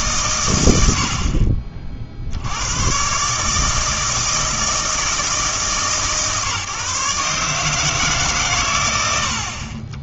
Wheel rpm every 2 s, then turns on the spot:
90, 100, 160, 150, 120.
none